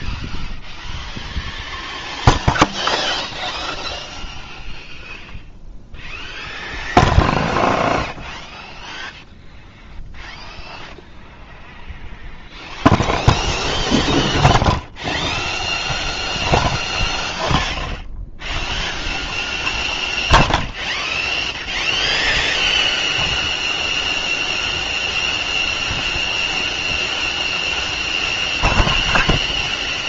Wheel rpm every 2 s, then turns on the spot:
0, 0, 0, 0, 0, 0, 0, 0, 0, 0, 0, 0, 0, 0, 0.
none